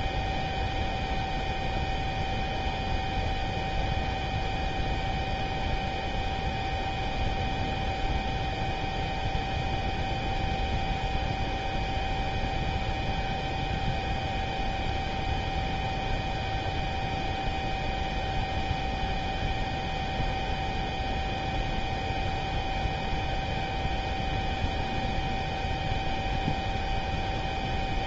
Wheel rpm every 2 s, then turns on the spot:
0, 0, 0, 0, 0, 0, 0, 0, 0, 0, 0, 0, 0, 0.
none